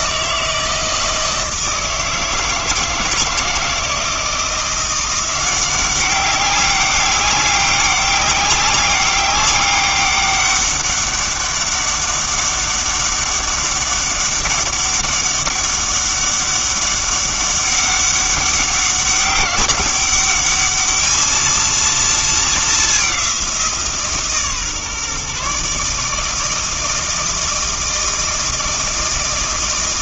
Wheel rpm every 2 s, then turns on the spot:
160, 160, 170, 190, 200, 200, 200, 200, 200, 200, 210, 210, 140, 160, 160.
none